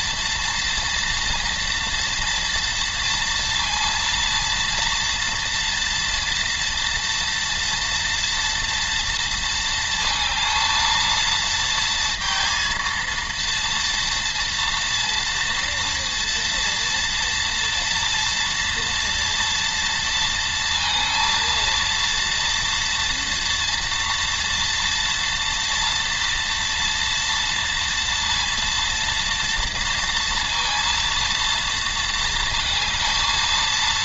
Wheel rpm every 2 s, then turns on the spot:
230, 230, 230, 230, 230, 220, 230, 230, 230, 230, 230, 230, 230, 230, 230, 230, 230.
none